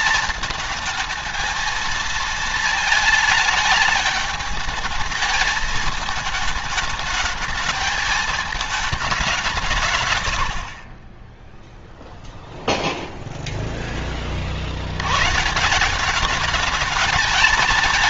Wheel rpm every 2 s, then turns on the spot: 220, 220, 210, 210, 200, 20, 0, 100, 220.
none